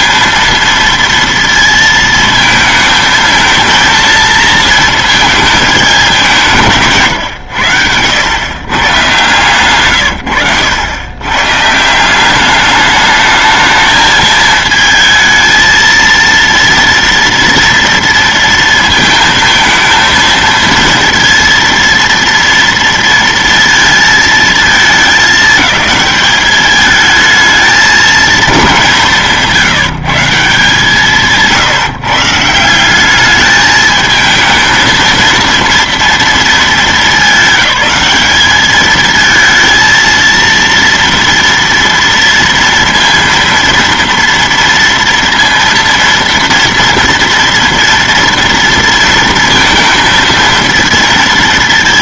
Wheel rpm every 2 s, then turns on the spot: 230, 220, 220, 160, 130, 100, 210, 220, 230, 230, 230, 230, 220, 210, 190, 170, 170, 220, 220, 210, 230, 230, 230, 230, 230, 230.
none